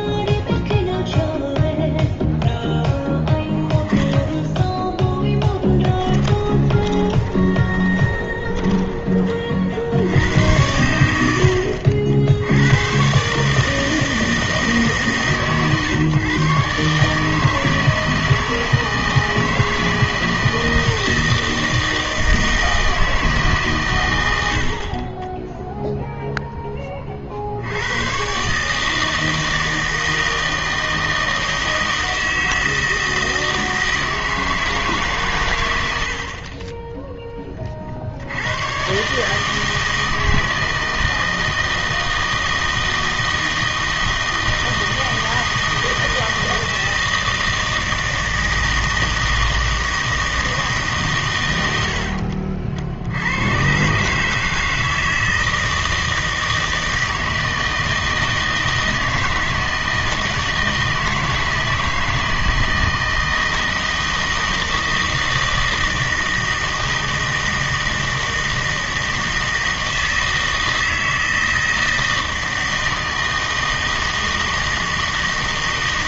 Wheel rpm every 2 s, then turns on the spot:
0, 0, 10, 20, 10, 100, 90, 160, 140, 160, 160, 160, 70, 10, 150, 160, 160, 160, 30, 100, 160, 160, 160, 160, 160, 160, 60, 160, 160, 160, 160, 160, 160, 160, 160, 160, 160, 160.
6-10